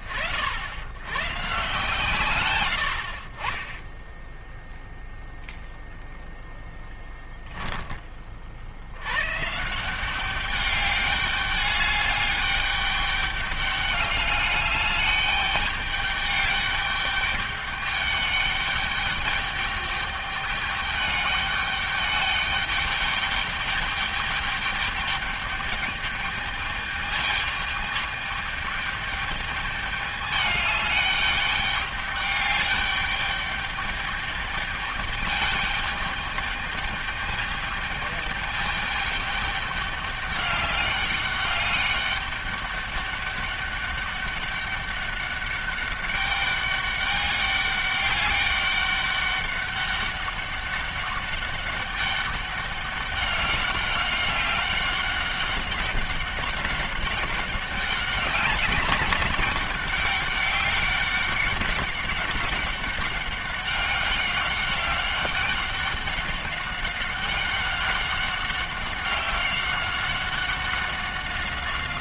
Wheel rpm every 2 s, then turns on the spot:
100, 90, 0, 10, 90, 200, 200, 210, 200, 210, 210, 210, 210, 210, 210, 210, 210, 210, 210, 210, 200, 200, 200, 200, 200, 200, 200, 200, 190, 190, 190, 200, 200, 190, 190, 190.
none